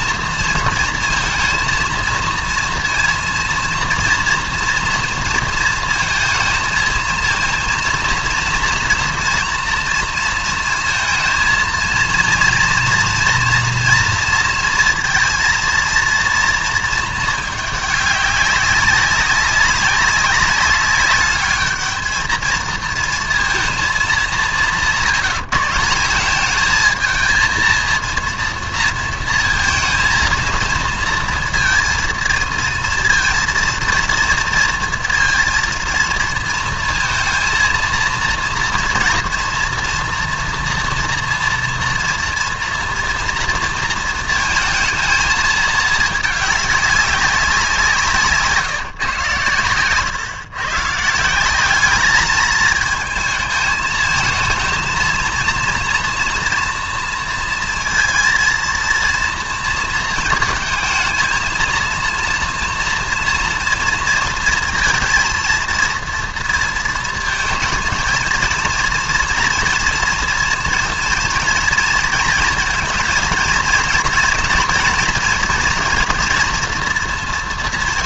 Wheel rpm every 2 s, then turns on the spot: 230, 230, 230, 230, 230, 230, 230, 230, 230, 200, 200, 230, 170, 220, 230, 230, 230, 230, 230, 230, 230, 230, 230, 210, 150, 140, 220, 230, 230, 230, 230, 240, 230, 230, 230, 230, 230, 230, 230.
none